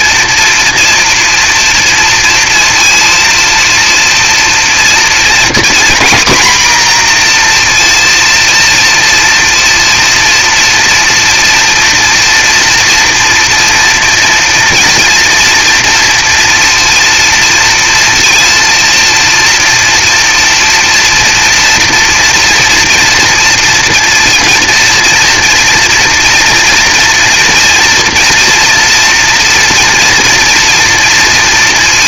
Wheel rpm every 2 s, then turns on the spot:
230, 230, 230, 240, 230, 240, 230, 230, 230, 230, 230, 230, 230, 230, 230, 230.
none